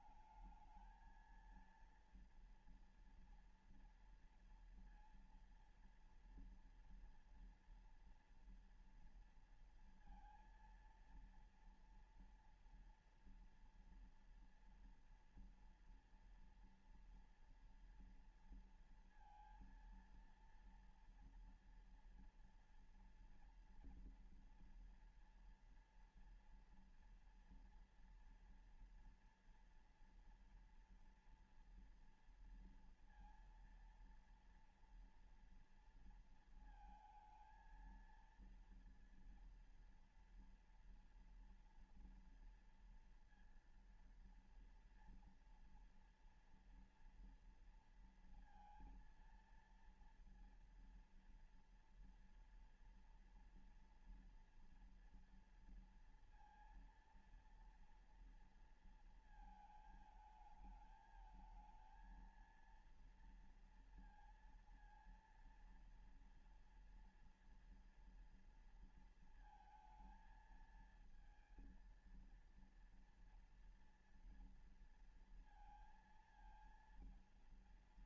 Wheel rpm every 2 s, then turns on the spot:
220, 230, 230, 230, 230, 230, 230, 240, 230, 230, 230, 230, 230, 230, 230, 230, 230, 230, 230, 230, 230, 230, 230, 240, 230, 230, 240, 230, 230, 230, 220, 230, 230, 230, 230, 220, 230, 230, 220.
none